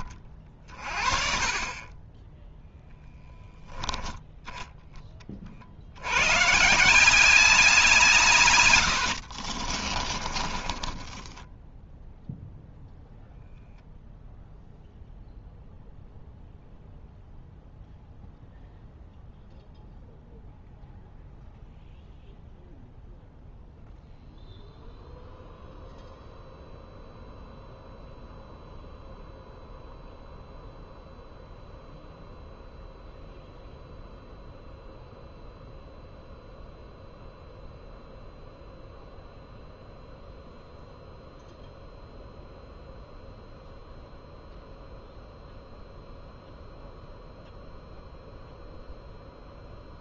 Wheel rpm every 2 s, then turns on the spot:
30, 0, 10, 160, 110, 30, 0, 0, 0, 0, 0, 0, 0, 0, 0, 0, 0, 0, 0, 0, 0, 0, 0, 0, 0.
8-12